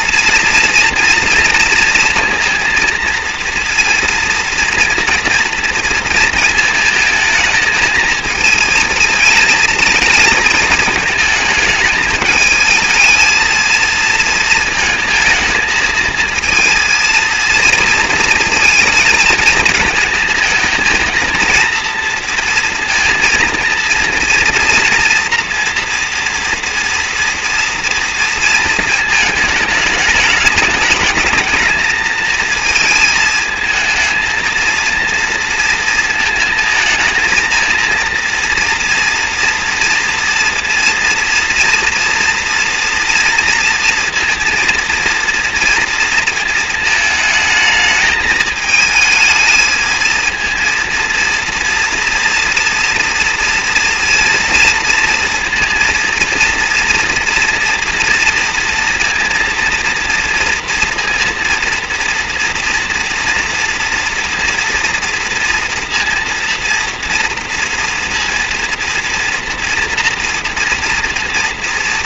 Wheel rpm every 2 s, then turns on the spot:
230, 230, 230, 230, 220, 220, 220, 230, 230, 230, 220, 230, 230, 240, 220, 210, 220, 230, 220, 230, 230, 230, 230, 220, 220, 230, 230, 230, 230, 240, 230, 230, 230, 230, 230, 230.
none